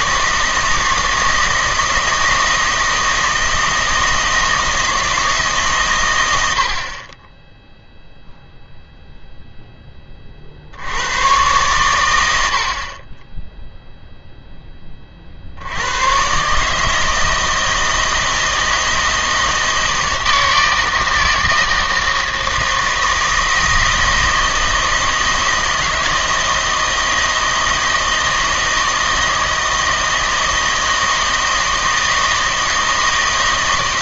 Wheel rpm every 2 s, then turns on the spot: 160, 160, 160, 70, 0, 60, 60, 10, 150, 160, 160, 160, 160, 160, 170, 160, 160.
none